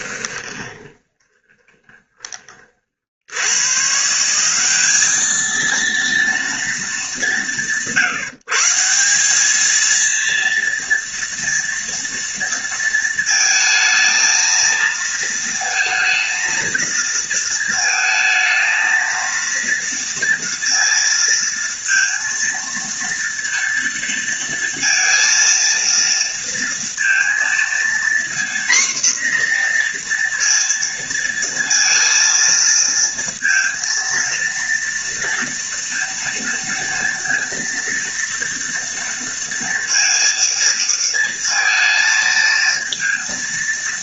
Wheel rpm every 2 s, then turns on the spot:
20, 50, 200, 190, 170, 230, 230, 230, 230, 230, 230, 230, 230, 230, 240, 230, 230, 230, 230, 230, 230, 230.
0-2